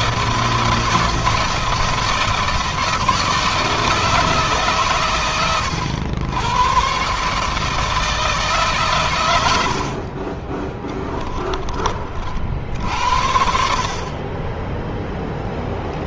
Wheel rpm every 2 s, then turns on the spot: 160, 160, 140, 120, 120, 20, 60, 10.
10-12